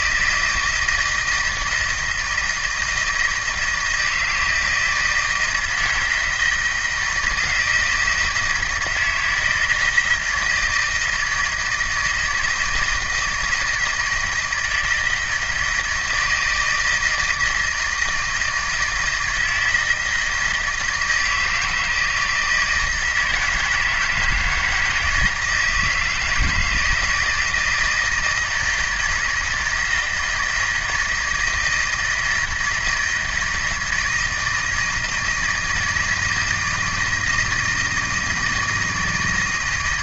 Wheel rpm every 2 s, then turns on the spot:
160, 160, 160, 160, 170, 160, 170, 160, 160, 160, 160, 160, 160, 160, 160, 160, 160, 160, 160, 160.
none